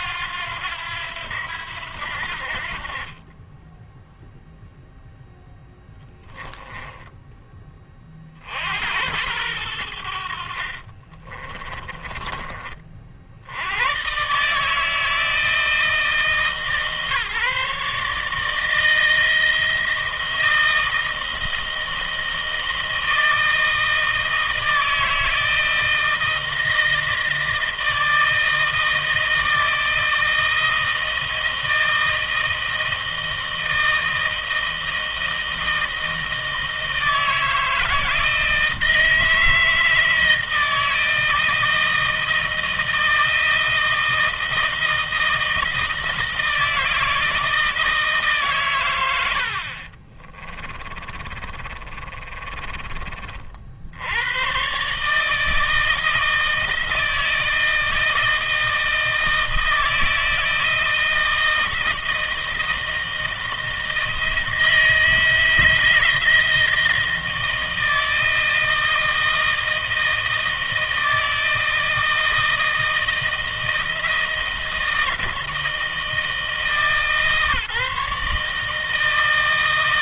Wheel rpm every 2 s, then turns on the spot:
90, 60, 0, 10, 50, 70, 40, 150, 140, 160, 160, 160, 160, 160, 160, 160, 160, 160, 160, 160, 160, 160, 160, 160, 130, 30, 30, 120, 160, 160, 160, 160, 160, 160, 160, 160, 160, 160, 160, 160.
50-54